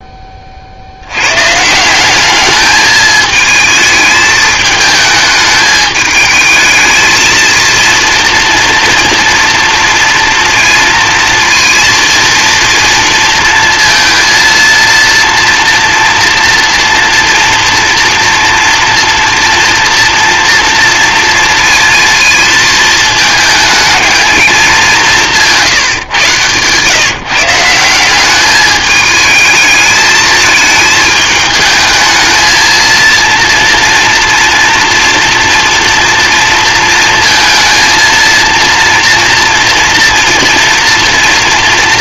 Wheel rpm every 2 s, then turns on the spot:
40, 210, 220, 220, 230, 230, 230, 230, 230, 230, 230, 220, 210, 120, 200, 220, 220, 230, 230, 230, 240.
none